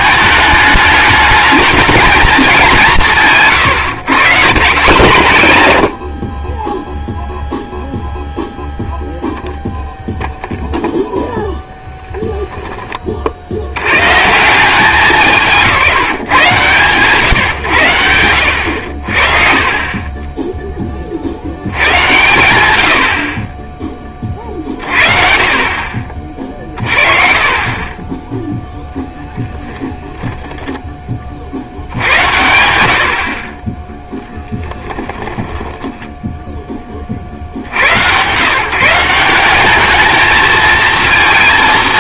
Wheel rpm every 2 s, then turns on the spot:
210, 190, 180, 20, 0, 0, 20, 170, 140, 100, 10, 100, 40, 40, 10, 10, 90, 10, 10, 130, 220.
12-14 34-36